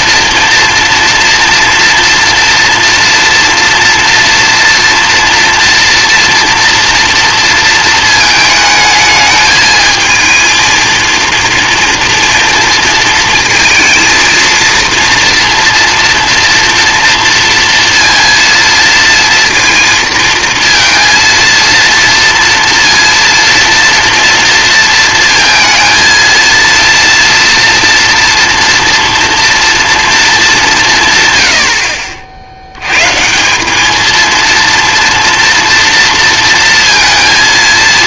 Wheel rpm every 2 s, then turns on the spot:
230, 230, 240, 230, 220, 230, 230, 230, 230, 230, 230, 230, 230, 230, 230, 180, 90, 230, 230.
none